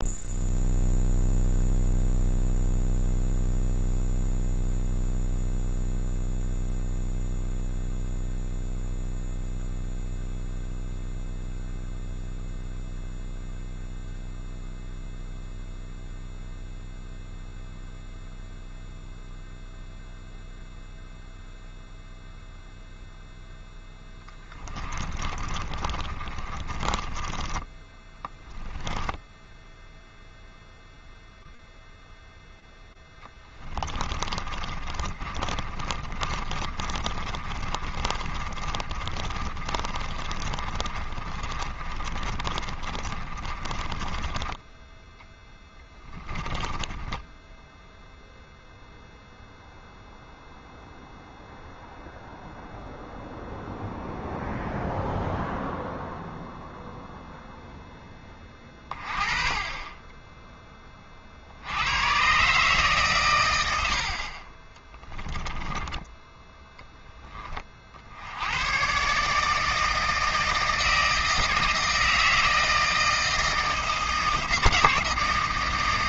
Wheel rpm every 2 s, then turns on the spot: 0, 0, 0, 0, 0, 0, 0, 0, 0, 0, 0, 0, 20, 30, 10, 0, 0, 30, 30, 30, 30, 40, 10, 20, 0, 0, 0, 0, 0, 30, 40, 120, 10, 10, 140, 160, 160, 150.
24-30 34-44 46-48